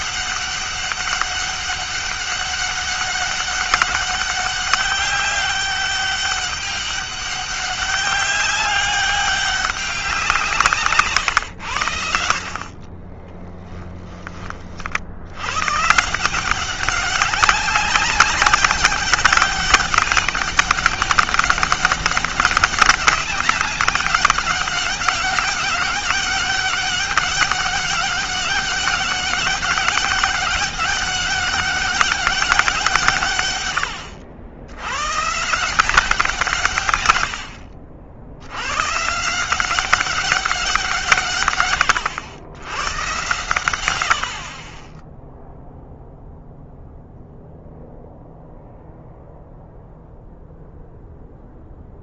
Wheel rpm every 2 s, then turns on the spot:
200, 200, 200, 200, 200, 150, 40, 50, 190, 190, 200, 200, 200, 200, 200, 200, 170, 100, 140, 110, 170, 100, 10, 0, 0, 0.
12-14